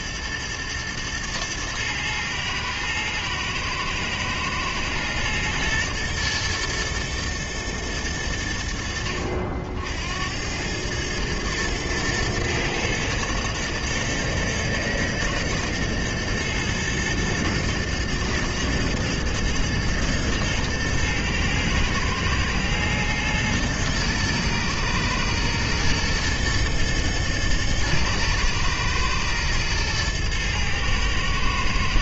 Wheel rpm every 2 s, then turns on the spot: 120, 110, 110, 120, 80, 100, 110, 120, 120, 120, 110, 120, 120, 110, 120, 110.
none